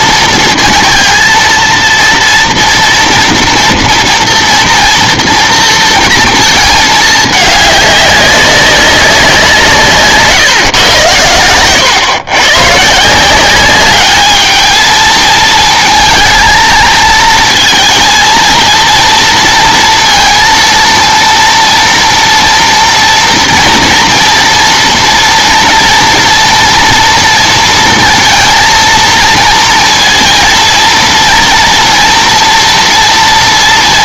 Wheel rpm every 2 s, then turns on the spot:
230, 230, 230, 220, 200, 140, 130, 220, 230, 230, 230, 230, 230, 230, 230, 230, 230.
none